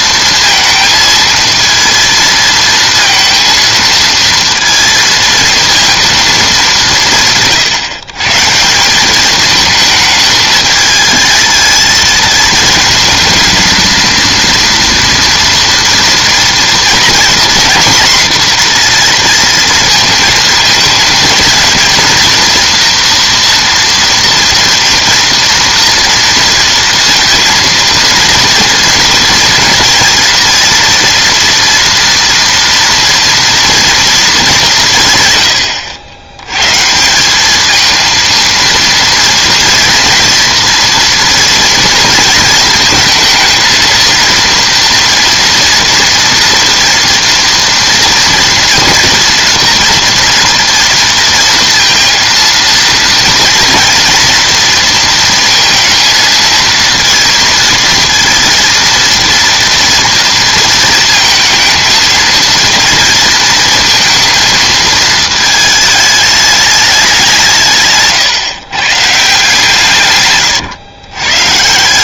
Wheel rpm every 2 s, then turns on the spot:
230, 230, 230, 210, 150, 210, 220, 230, 230, 240, 220, 230, 240, 230, 230, 230, 230, 190, 100, 230, 240, 220, 230, 240, 230, 230, 230, 230, 230, 230, 230, 230, 220, 210, 140, 120.
none